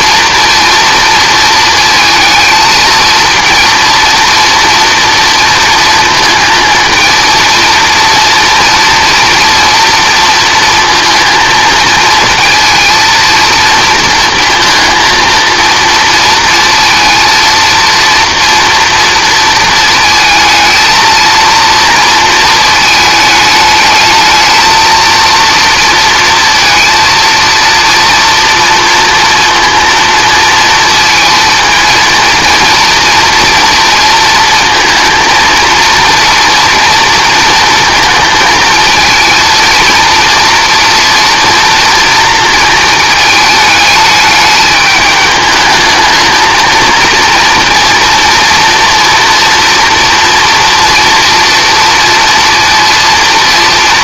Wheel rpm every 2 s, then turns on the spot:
230, 220, 230, 230, 230, 230, 230, 230, 230, 230, 220, 230, 210, 230, 230, 230, 230, 230, 230, 230, 230, 240, 210, 220, 230, 230, 230.
none